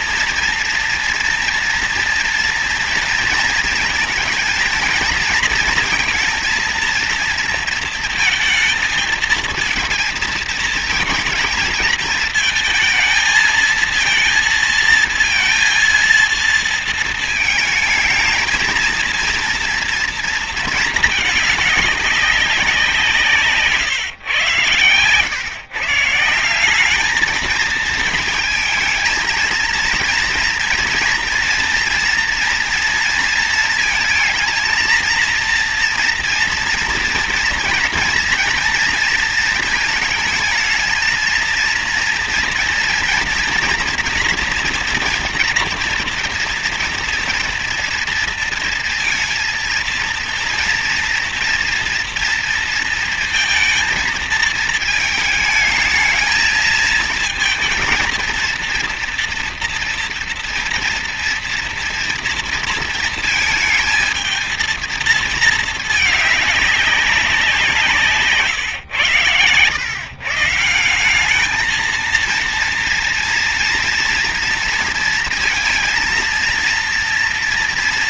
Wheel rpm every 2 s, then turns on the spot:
230, 230, 230, 230, 230, 230, 230, 230, 230, 220, 230, 200, 110, 160, 220, 230, 230, 230, 230, 240, 220, 230, 230, 230, 230, 230, 230, 220, 220, 230, 230, 230, 220, 210, 140, 140, 230, 230, 230.
none